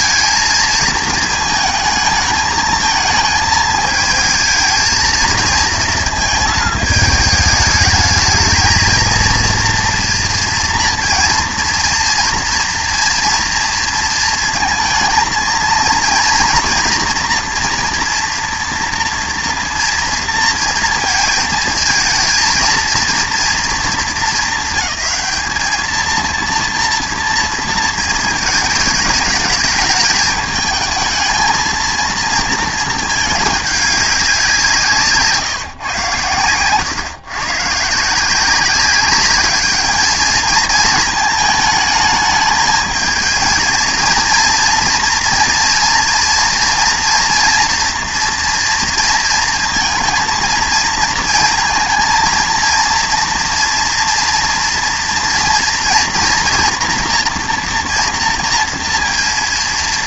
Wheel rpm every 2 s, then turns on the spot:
230, 220, 220, 220, 220, 230, 230, 220, 230, 230, 230, 230, 200, 230, 220, 220, 220, 180, 120, 190, 220, 220, 230, 240, 230, 230, 230, 230, 230, 230.
none